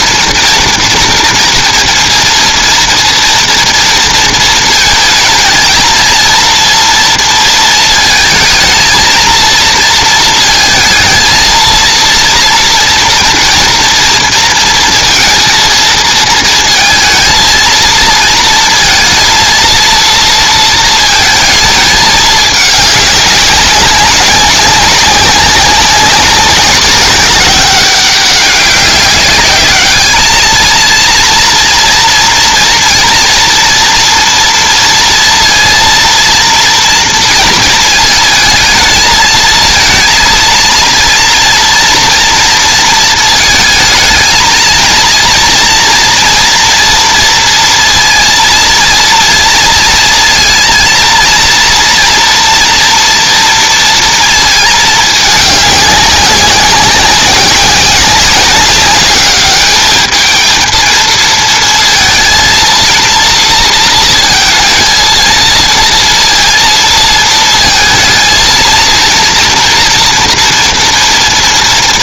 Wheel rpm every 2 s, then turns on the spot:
240, 240, 220, 230, 220, 220, 230, 230, 230, 230, 230, 210, 190, 190, 200, 230, 230, 230, 230, 220, 230, 230, 230, 230, 230, 230, 240, 220, 190, 200, 230, 230, 230, 230, 230, 230.
none